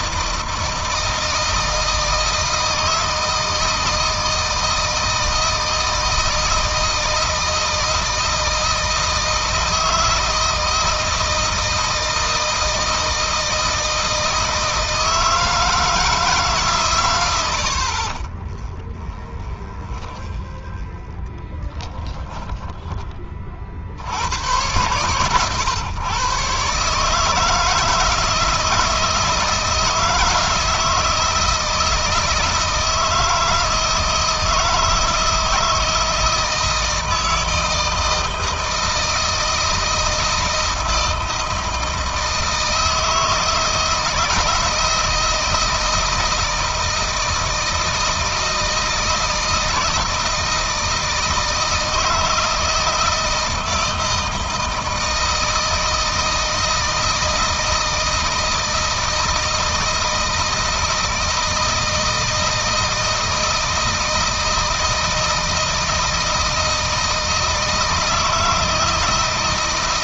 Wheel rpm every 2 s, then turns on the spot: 160, 160, 160, 160, 160, 160, 160, 160, 140, 20, 10, 10, 100, 140, 160, 160, 160, 160, 160, 160, 160, 160, 160, 160, 160, 160, 160, 160, 160, 160, 160, 160, 160, 160, 160.
18-22